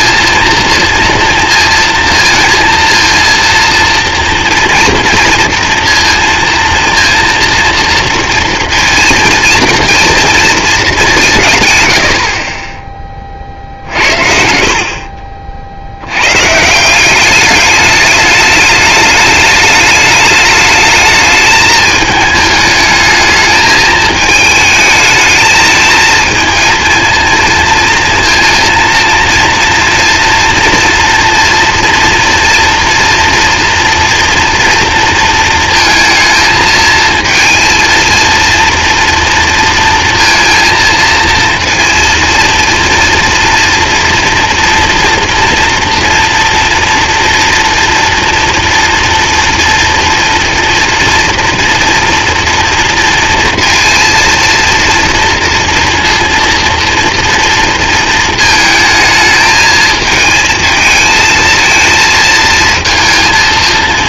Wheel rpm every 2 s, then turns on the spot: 230, 230, 230, 230, 230, 220, 30, 60, 150, 210, 210, 220, 220, 230, 230, 230, 240, 230, 230, 230, 230, 230, 230, 240, 230, 230, 230, 230, 230, 220, 220, 230.
14-16